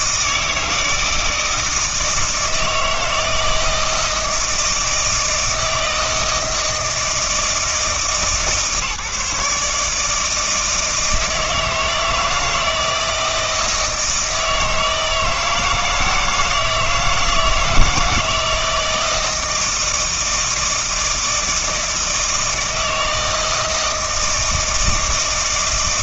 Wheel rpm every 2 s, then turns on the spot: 160, 160, 160, 160, 150, 160, 160, 160, 160, 160, 160, 160, 160.
none